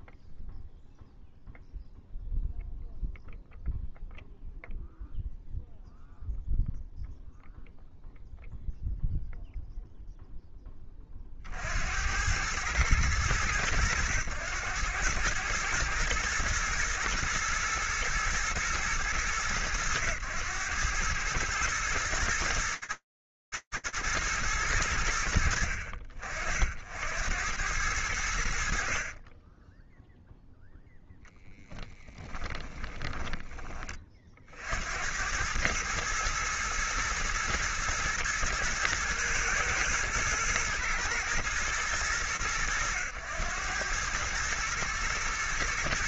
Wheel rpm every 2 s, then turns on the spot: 0, 0, 0, 0, 0, 0, 80, 100, 110, 110, 110, 110, 110, 60, 50, 0, 10, 80, 110, 110, 110, 100, 110.
32-34